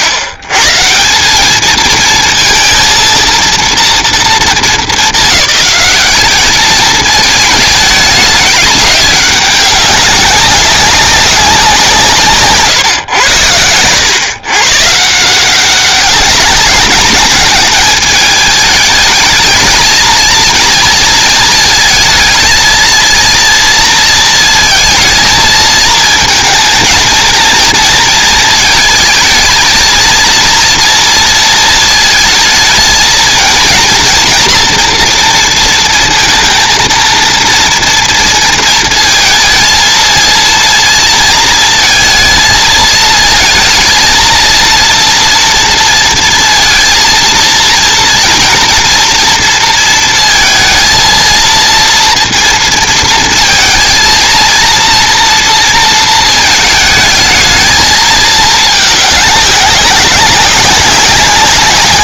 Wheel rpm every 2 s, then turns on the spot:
120, 230, 210, 210, 200, 190, 140, 130, 190, 210, 220, 220, 220, 220, 220, 230, 220, 230, 230, 220, 230, 220, 230, 230, 230, 230, 230, 230, 220, 210, 190.
none